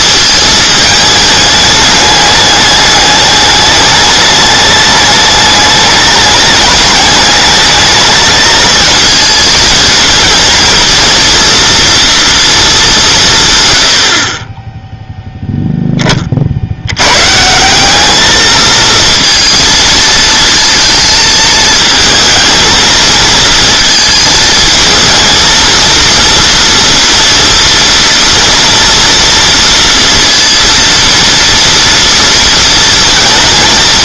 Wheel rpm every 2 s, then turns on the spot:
220, 210, 210, 210, 220, 230, 220, 10, 70, 220, 230, 220, 220, 230, 230, 230, 230.
none